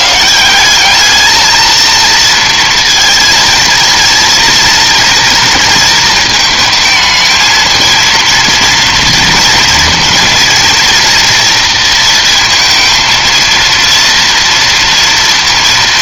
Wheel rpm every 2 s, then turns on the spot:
170, 230, 230, 220, 230, 230, 230, 230.
none